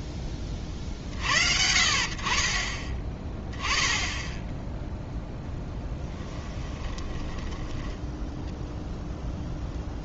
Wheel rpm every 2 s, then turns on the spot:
30, 30, 0, 10, 10.
6-8